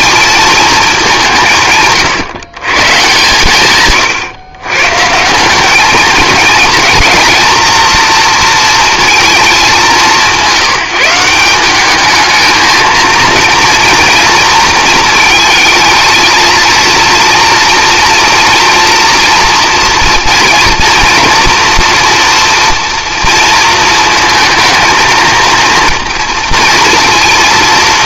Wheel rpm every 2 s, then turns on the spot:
220, 140, 130, 230, 230, 180, 220, 230, 230, 230, 230, 240, 230, 220.
none